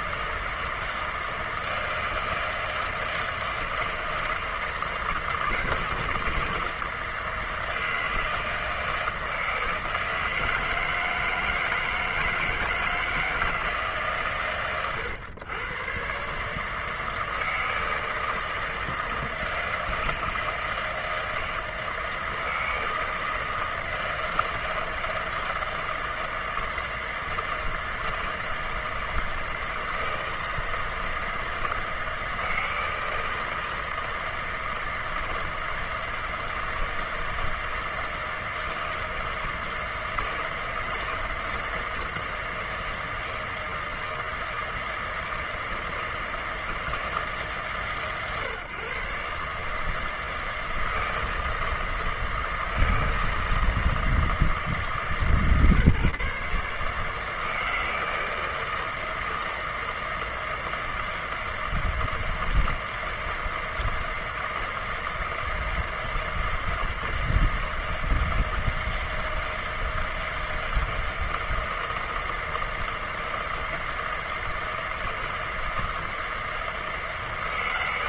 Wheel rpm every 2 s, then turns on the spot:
160, 160, 160, 160, 160, 160, 160, 130, 160, 160, 160, 160, 160, 160, 160, 160, 160, 160, 160, 160, 160, 160, 160, 150, 140, 160, 160, 150, 160, 160, 160, 160, 160, 160, 160, 160, 160, 160, 160.
none